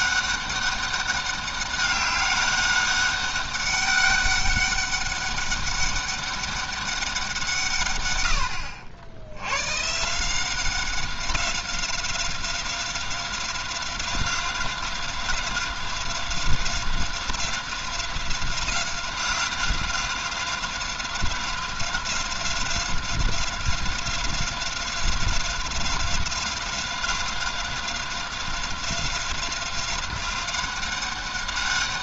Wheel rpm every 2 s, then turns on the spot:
200, 200, 200, 200, 80, 190, 180, 180, 180, 190, 180, 180, 180, 180, 180, 190.
none